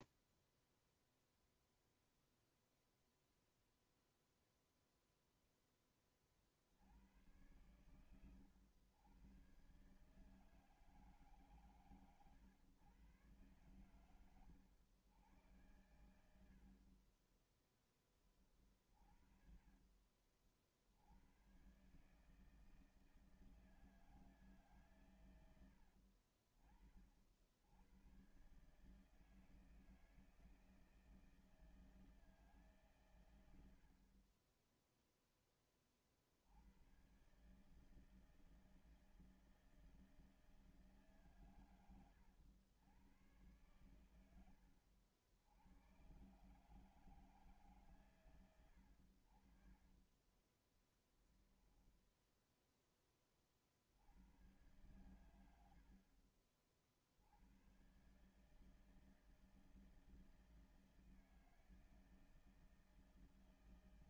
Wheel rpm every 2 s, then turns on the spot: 0, 0, 0, 40, 110, 150, 120, 100, 80, 20, 50, 150, 150, 60, 120, 160, 160, 40, 60, 160, 160, 100, 100, 130, 130, 10, 0, 90, 50, 140, 160, 160.
50-52